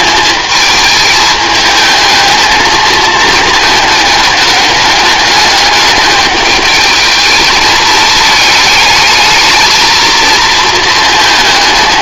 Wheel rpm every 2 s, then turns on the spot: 210, 220, 210, 210, 220, 230.
none